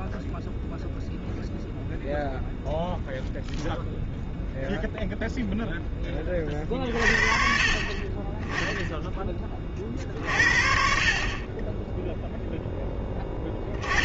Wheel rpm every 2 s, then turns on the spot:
0, 0, 0, 50, 10, 50, 10.
none